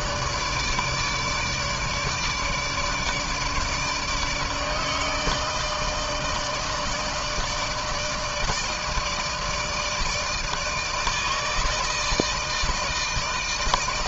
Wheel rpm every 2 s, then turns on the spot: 150, 150, 150, 160, 160, 160, 160.
none